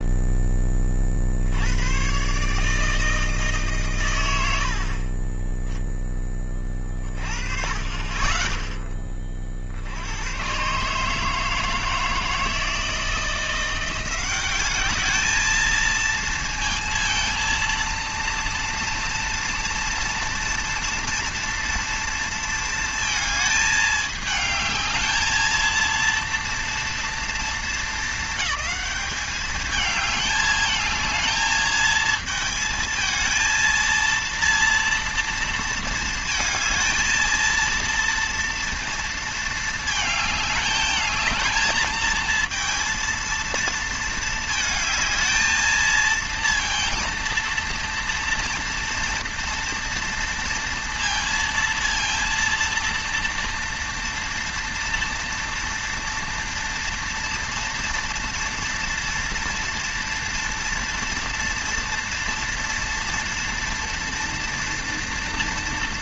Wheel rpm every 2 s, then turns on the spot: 10, 140, 80, 20, 20, 120, 160, 190, 230, 230, 230, 230, 220, 230, 220, 210, 220, 230, 220, 230, 210, 230, 220, 230, 230, 230, 230, 230, 230, 230, 240, 230, 230.
none